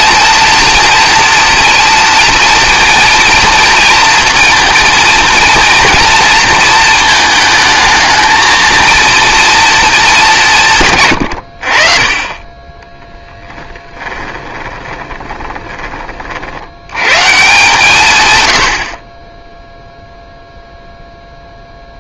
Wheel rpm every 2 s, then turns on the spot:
230, 230, 230, 220, 230, 160, 10, 20, 120, 60, 0.
12-16